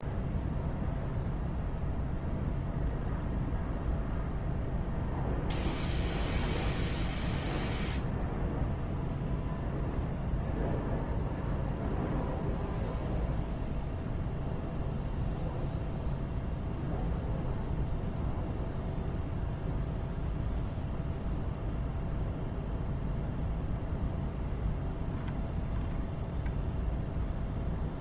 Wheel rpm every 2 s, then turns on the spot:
0, 0, 0, 0, 0, 0, 0, 0, 0, 0, 0, 0, 0, 0.
none